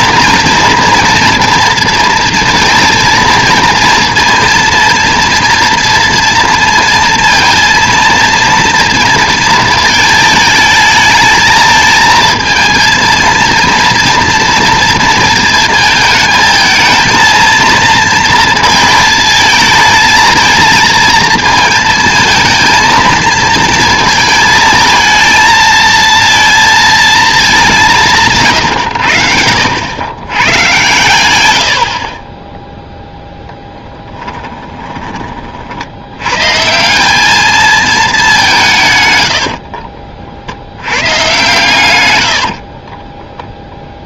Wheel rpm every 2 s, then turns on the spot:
240, 230, 230, 230, 230, 220, 230, 230, 220, 220, 230, 230, 220, 230, 120, 120, 0, 10, 160, 160, 80, 50.
34-36 42-44